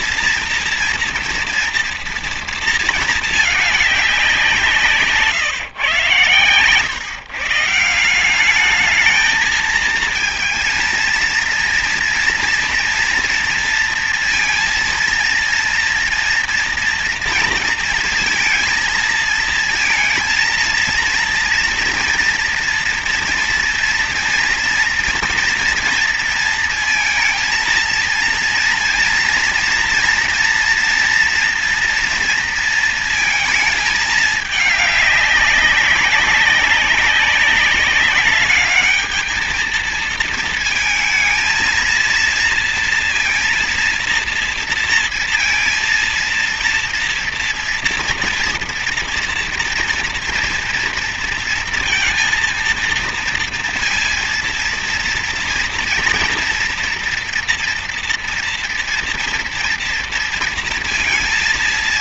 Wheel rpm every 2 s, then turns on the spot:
230, 230, 180, 120, 190, 230, 240, 230, 230, 230, 230, 240, 230, 230, 230, 230, 230, 210, 190, 200, 230, 230, 230, 230, 230, 230, 230, 230, 230, 230, 230.
none